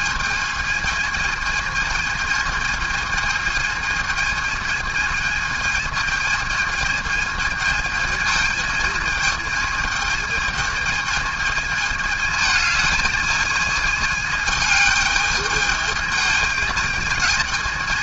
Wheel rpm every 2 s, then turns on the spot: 220, 220, 220, 220, 220, 220, 220, 210, 220.
none